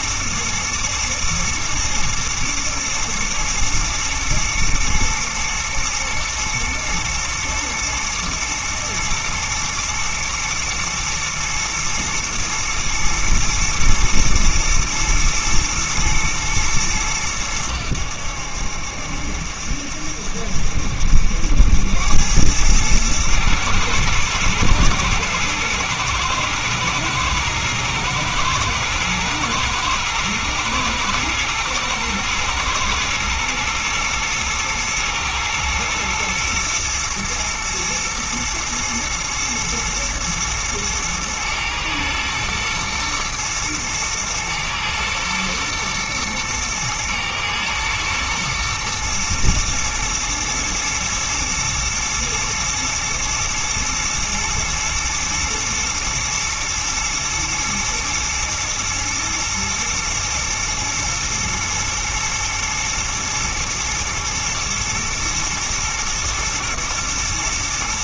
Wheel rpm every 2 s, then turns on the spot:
110, 120, 120, 120, 120, 120, 110, 110, 110, 70, 70, 100, 120, 110, 110, 110, 110, 110, 110, 120, 120, 120, 120, 120, 120, 110, 120, 110, 110, 120, 120, 110, 110, 110.
none